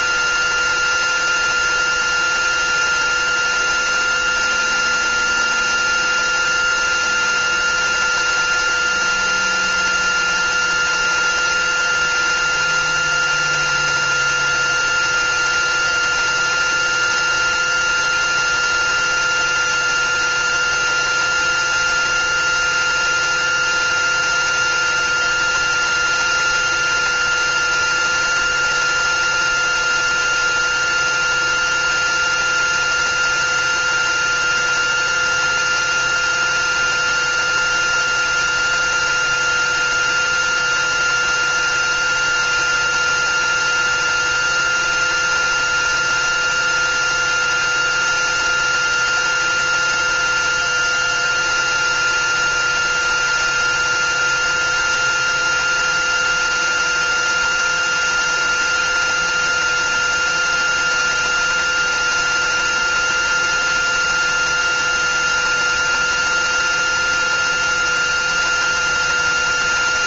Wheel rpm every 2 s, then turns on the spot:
370, 370, 370, 370, 370, 370, 370, 370, 360, 360, 360, 360, 370, 360, 370, 360, 370, 370, 360, 360, 370, 370, 360, 370, 370, 370, 370, 370, 370, 370, 370, 370, 370, 370, 370.
none